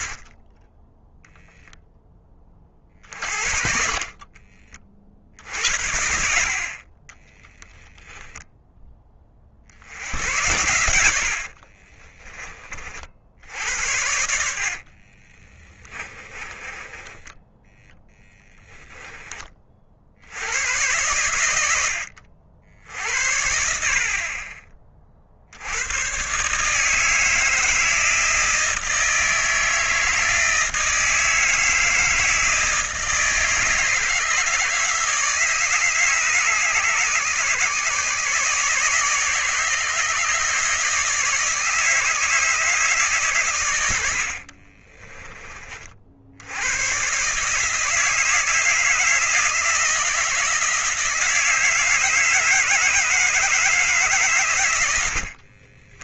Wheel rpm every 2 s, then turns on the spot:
20, 40, 30, 50, 10, 90, 30, 60, 20, 10, 100, 70, 30, 160, 160, 160, 160, 160, 150, 150, 150, 150, 30, 110, 160, 160, 160, 100.
10-12 14-18 44-46